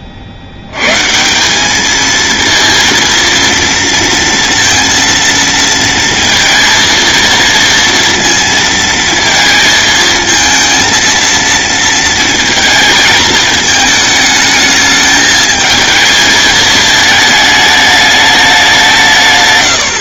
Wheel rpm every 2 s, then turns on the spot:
130, 230, 230, 230, 230, 230, 230, 210, 220, 180.
none